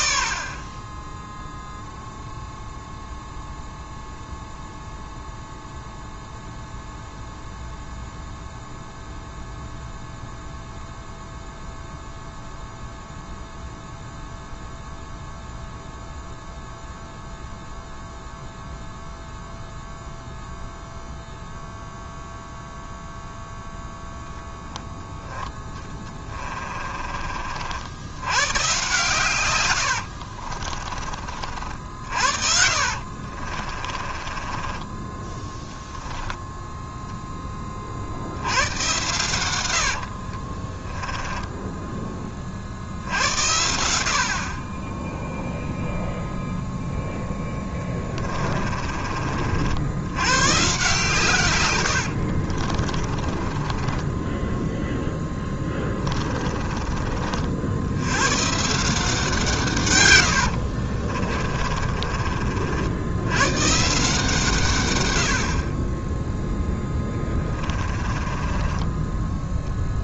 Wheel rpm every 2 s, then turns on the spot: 40, 0, 0, 0, 0, 0, 0, 0, 0, 0, 0, 0, 10, 20, 120, 30, 60, 20, 0, 100, 30, 50, 30, 0, 30, 130, 50, 10, 30, 150, 70, 50, 140, 10, 20.
26-28 30-36 40-42 48-50 52-56 60-62 66-70